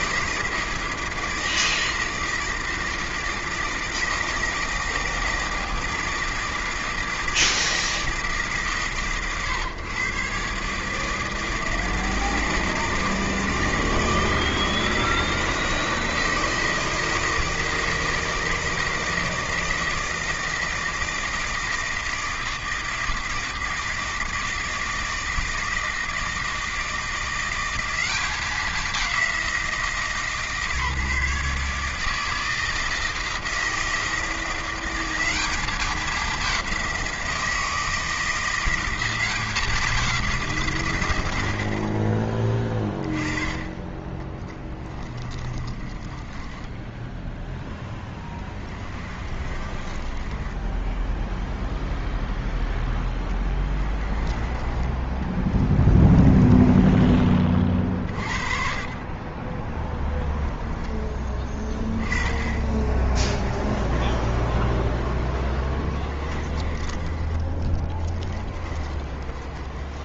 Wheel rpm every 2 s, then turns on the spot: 160, 160, 160, 160, 140, 150, 160, 160, 160, 160, 160, 160, 160, 160, 190, 150, 160, 170, 190, 170, 150, 20, 20, 10, 20, 10, 10, 20, 20, 40, 0, 10, 0, 20, 20.
44-52 56-58 66-70